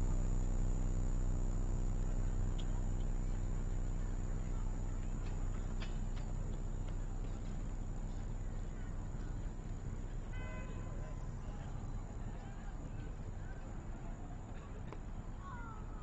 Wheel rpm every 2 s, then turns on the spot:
0, 0, 0, 0, 0, 0, 0, 0.
none